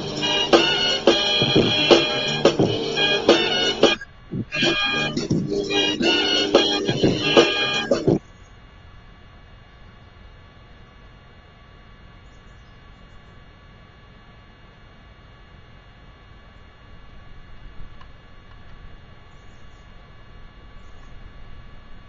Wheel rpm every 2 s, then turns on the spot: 0, 0, 0, 0, 0, 0, 0, 0, 0, 0, 0.
none